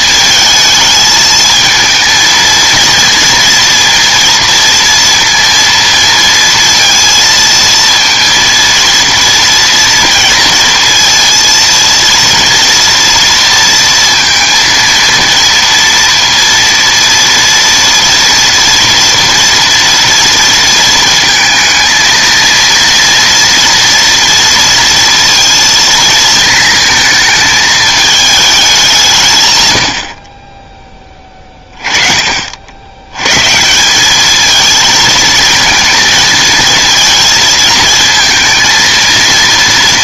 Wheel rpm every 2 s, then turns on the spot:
220, 230, 230, 230, 230, 230, 230, 230, 230, 230, 230, 230, 230, 220, 200, 30, 60, 220, 220, 230.
none